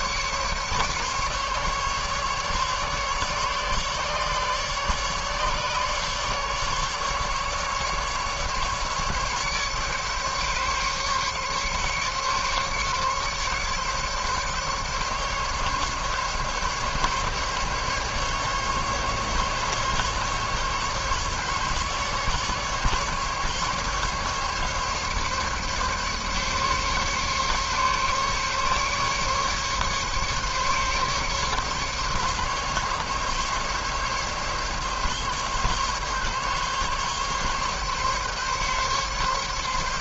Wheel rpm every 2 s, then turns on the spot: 150, 150, 140, 150, 140, 140, 140, 140, 140, 140, 140, 140, 140, 140, 140, 140, 140, 140, 140, 140.
none